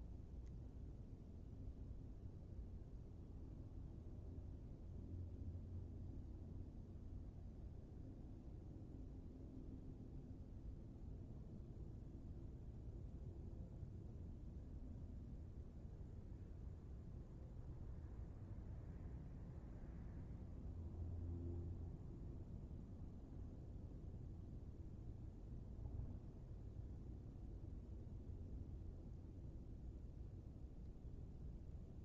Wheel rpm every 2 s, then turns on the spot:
0, 0, 0, 0, 0, 0, 0, 0, 0, 0, 0, 0, 0, 0, 0, 0.
none